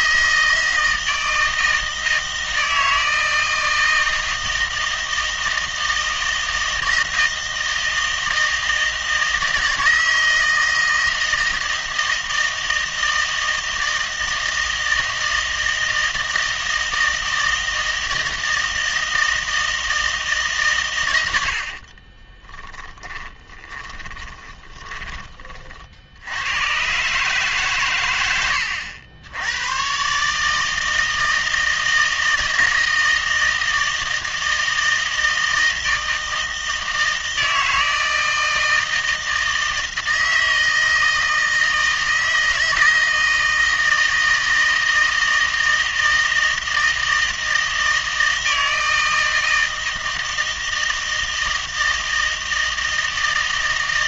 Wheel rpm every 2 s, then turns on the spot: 160, 160, 160, 160, 160, 160, 160, 160, 160, 160, 140, 20, 20, 110, 90, 160, 160, 160, 160, 160, 160, 160, 160, 160, 160, 160, 160.
22-26